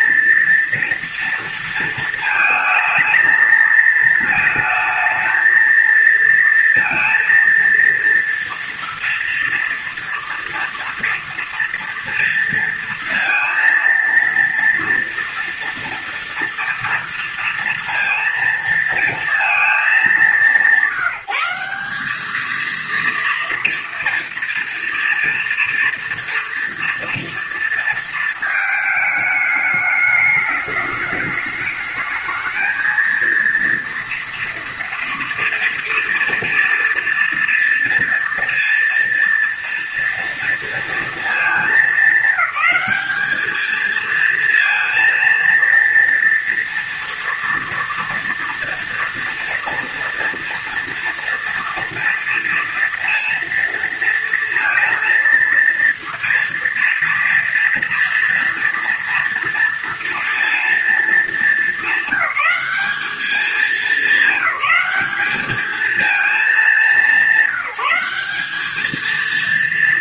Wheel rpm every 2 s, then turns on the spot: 230, 220, 220, 230, 230, 230, 230, 230, 230, 230, 190, 220, 230, 230, 220, 210, 220, 230, 230, 230, 230, 210, 220, 230, 230, 230, 230, 230, 230, 230, 230, 200, 210, 210, 200.
none